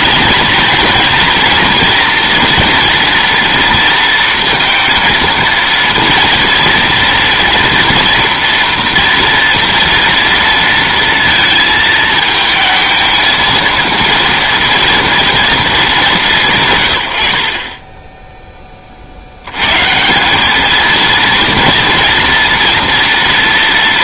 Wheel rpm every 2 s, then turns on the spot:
230, 230, 230, 240, 230, 230, 220, 230, 130, 30, 220, 230.
none